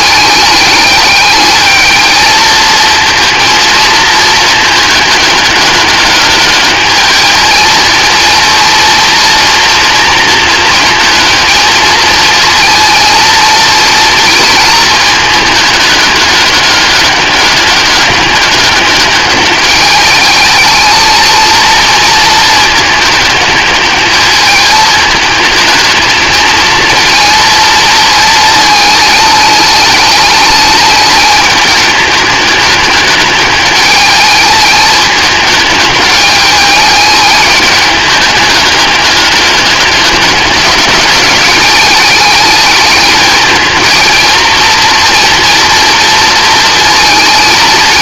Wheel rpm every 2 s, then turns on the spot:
210, 220, 210, 210, 230, 220, 230, 220, 200, 210, 220, 220, 220, 220, 220, 210, 210, 210, 210, 200, 200, 210, 230, 220.
none